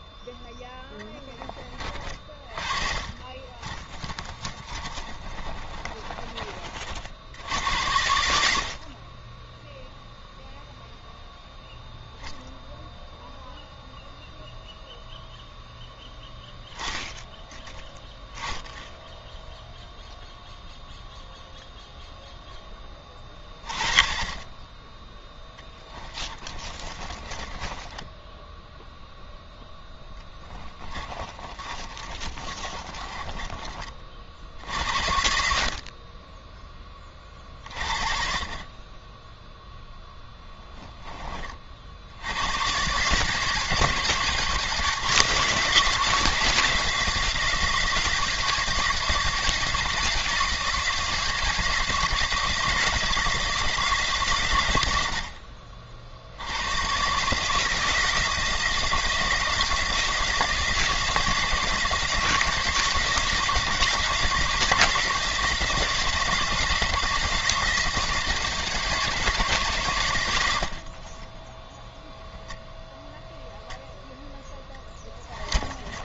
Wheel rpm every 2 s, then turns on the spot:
10, 40, 30, 50, 60, 0, 0, 0, 10, 0, 0, 10, 20, 30, 10, 20, 30, 70, 10, 40, 10, 110, 170, 170, 170, 160, 160, 110, 100, 170, 170, 160, 170, 170, 160, 70, 0, 10.
2-6 26-34 70-72 74-76